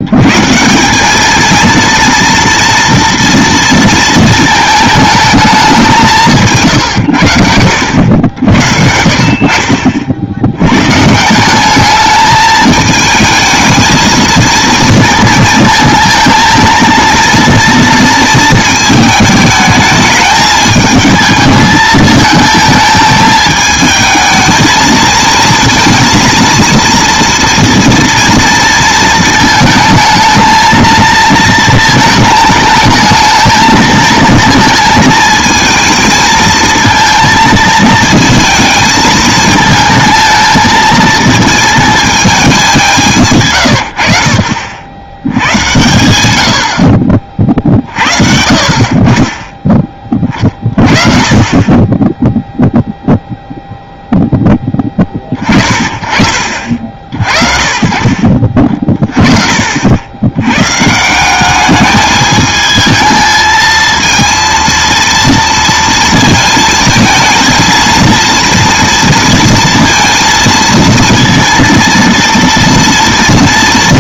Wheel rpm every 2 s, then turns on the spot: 180, 240, 220, 140, 70, 120, 210, 230, 230, 220, 220, 220, 220, 230, 230, 220, 220, 220, 230, 220, 220, 180, 80, 60, 50, 30, 0, 10, 40, 30, 130, 220, 230, 220, 230, 230, 230.
46-48